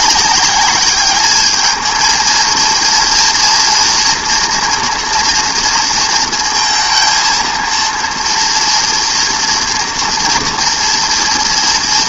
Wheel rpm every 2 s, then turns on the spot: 200, 230, 230, 230, 230, 230.
none